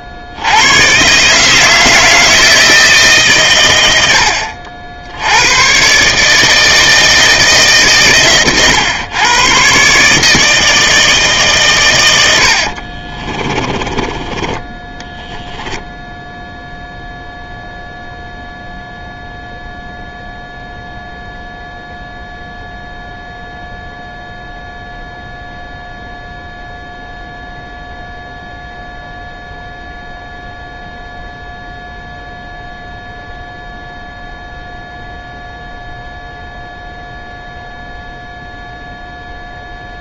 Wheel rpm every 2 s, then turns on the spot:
80, 160, 60, 160, 120, 160, 70, 20, 0, 0, 0, 0, 0, 0, 0, 0, 0, 0, 0, 0.
12-14